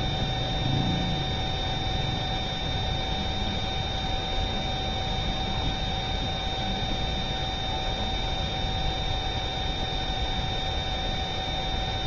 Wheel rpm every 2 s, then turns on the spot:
0, 0, 0, 0, 0, 0.
none